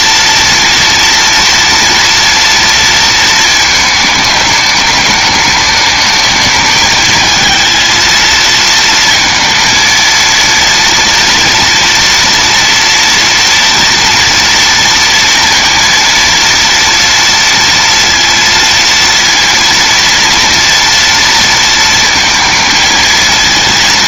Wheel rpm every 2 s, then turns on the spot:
230, 230, 210, 220, 230, 230, 230, 230, 230, 230, 230, 220.
none